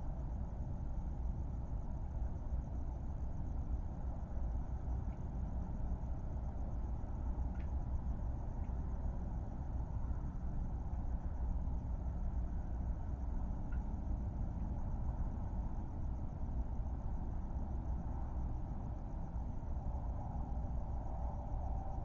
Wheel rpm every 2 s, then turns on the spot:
0, 0, 0, 0, 0, 0, 0, 0, 0, 0, 0.
none